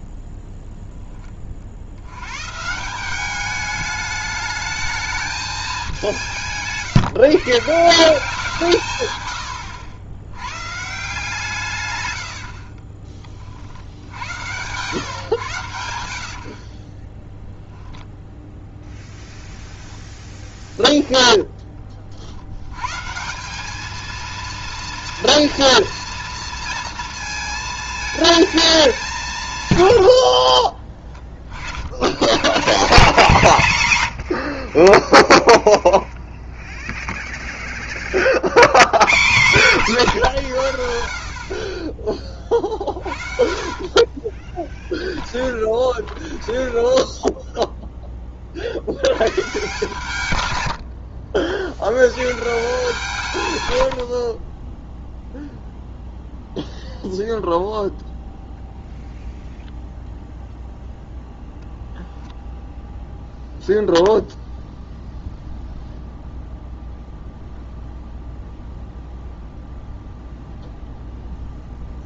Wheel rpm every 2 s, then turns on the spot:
0, 160, 220, 150, 150, 130, 50, 120, 40, 10, 0, 120, 230, 230, 210, 30, 160, 40, 0, 100, 90, 40, 10, 10, 70, 80, 160, 10, 0, 0, 0, 0, 0, 0, 0, 0.
12-14 16-18 30-32 42-48 50-52 54-56